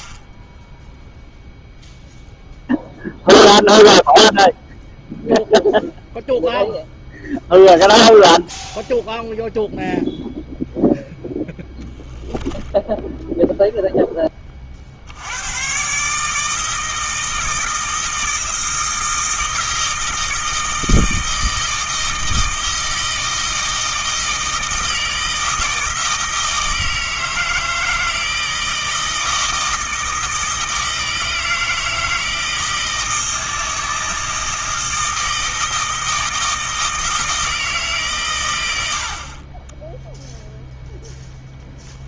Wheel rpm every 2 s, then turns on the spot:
0, 0, 0, 0, 0, 10, 10, 60, 160, 160, 160, 160, 160, 160, 160, 160, 160, 160, 160, 80, 0.
12-14